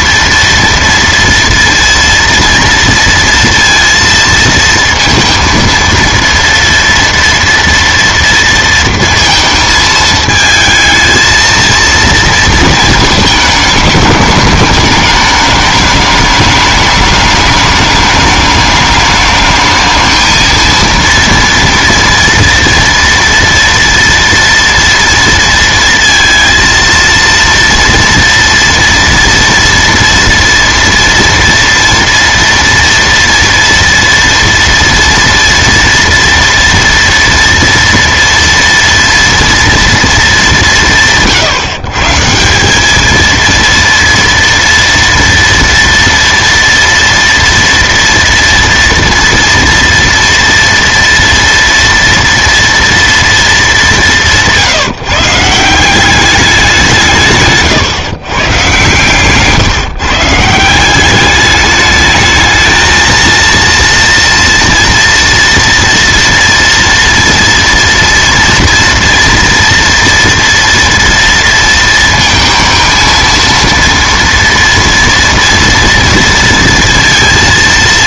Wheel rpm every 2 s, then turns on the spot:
230, 230, 230, 230, 230, 220, 230, 210, 210, 210, 220, 230, 230, 230, 230, 230, 230, 230, 230, 230, 200, 190, 230, 230, 230, 230, 230, 160, 190, 130, 160, 220, 240, 230, 230, 230, 230, 230, 230.
none